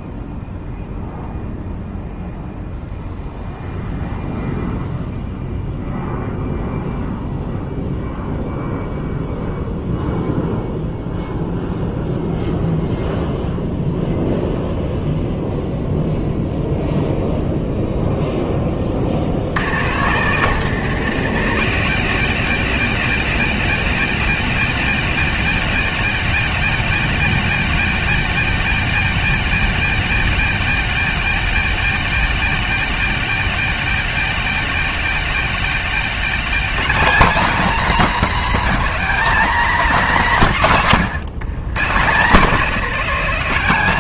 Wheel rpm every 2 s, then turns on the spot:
0, 0, 0, 0, 0, 0, 0, 0, 0, 20, 170, 250, 250, 250, 250, 250, 250, 250, 260, 260, 170, 210.
none